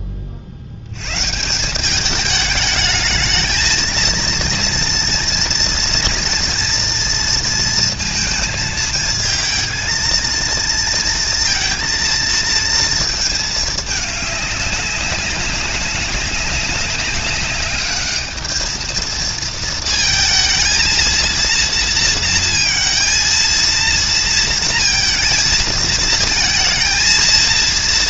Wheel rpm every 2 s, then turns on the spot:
80, 220, 230, 230, 230, 230, 220, 190, 190, 230, 230, 230, 220, 220.
none